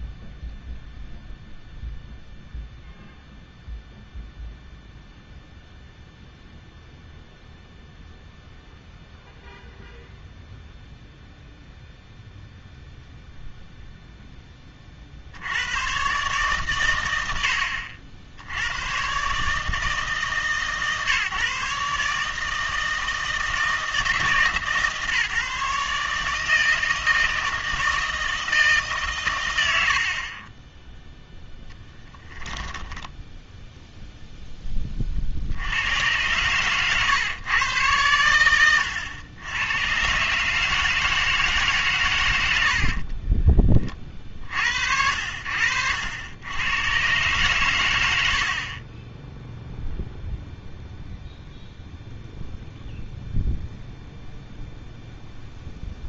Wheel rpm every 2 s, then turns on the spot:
0, 0, 0, 0, 0, 0, 0, 20, 120, 90, 150, 160, 160, 160, 160, 20, 10, 10, 120, 100, 150, 90, 60, 110, 40, 0, 0, 0.
36-38